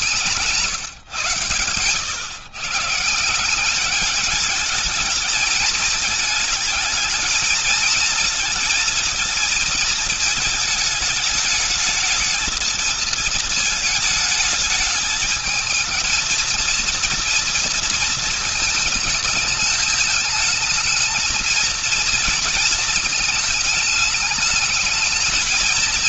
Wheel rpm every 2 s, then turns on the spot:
150, 130, 210, 220, 230, 220, 220, 220, 230, 220, 220, 230, 220.
none